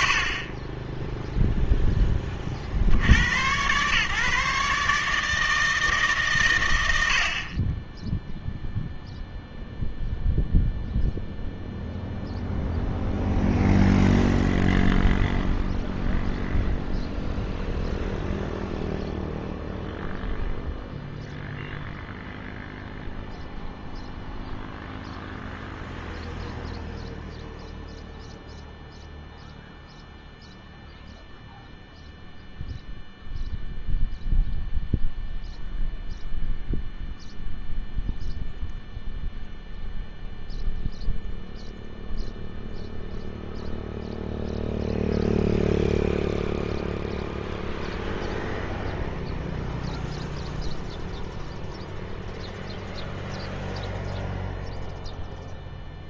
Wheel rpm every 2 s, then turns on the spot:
50, 70, 150, 100, 0, 0, 0, 0, 0, 0, 0, 0, 0, 0, 0, 0, 0, 0, 0, 0, 0, 0, 0, 0, 0, 0, 0, 0.
none